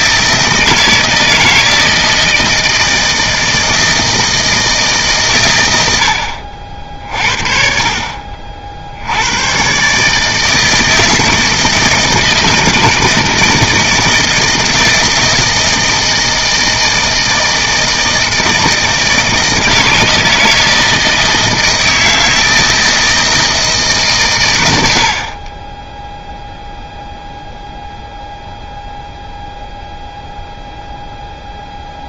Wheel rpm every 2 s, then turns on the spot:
160, 160, 160, 60, 60, 160, 160, 160, 160, 160, 160, 160, 90, 0, 0, 0.
none